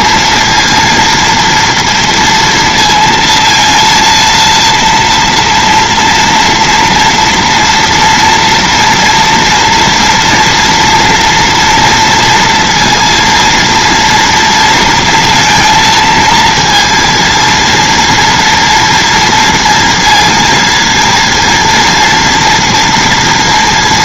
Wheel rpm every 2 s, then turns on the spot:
230, 230, 230, 230, 240, 230, 230, 230, 230, 230, 230, 230.
none